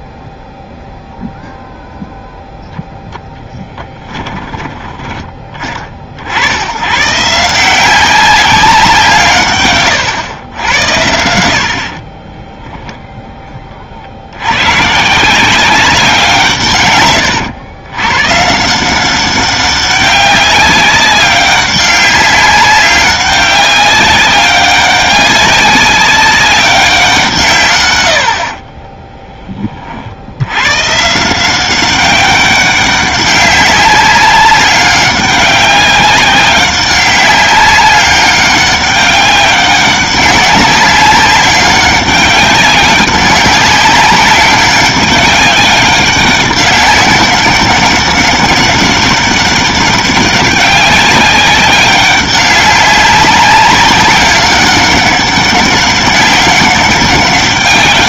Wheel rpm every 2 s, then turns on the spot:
0, 0, 20, 110, 170, 90, 0, 120, 130, 170, 200, 190, 200, 190, 30, 130, 200, 190, 190, 200, 200, 190, 190, 200, 200, 200, 190, 200, 200.
28-30